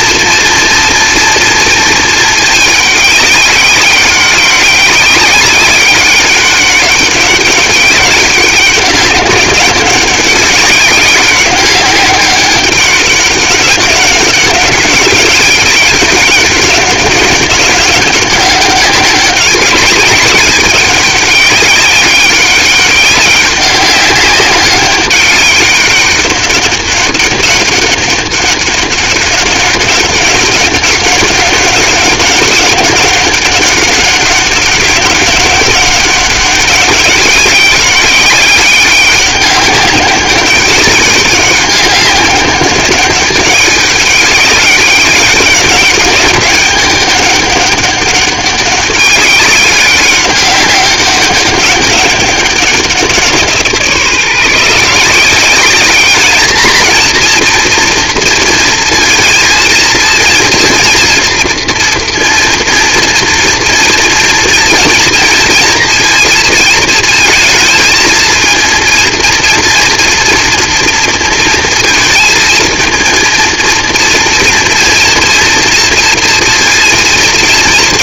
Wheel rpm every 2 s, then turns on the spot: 230, 210, 200, 200, 200, 200, 190, 200, 200, 190, 200, 200, 200, 200, 200, 190, 200, 200, 200, 200, 200, 200, 200, 200, 200, 200, 190, 160, 220, 230, 240, 230, 230, 220, 230, 230, 230, 230, 230.
none